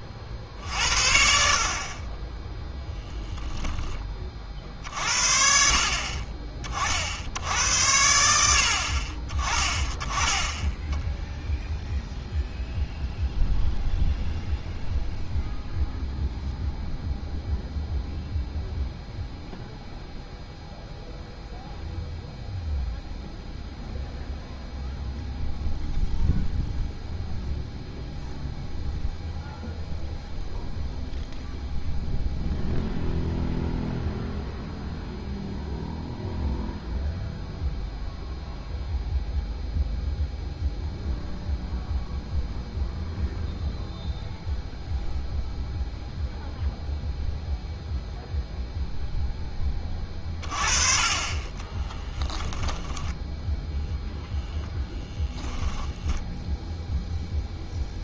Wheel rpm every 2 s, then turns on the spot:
60, 10, 50, 40, 60, 10, 0, 0, 0, 0, 0, 0, 0, 0, 0, 0, 0, 0, 0, 0, 0, 0, 0, 0, 0, 30, 10, 0, 0.
52-54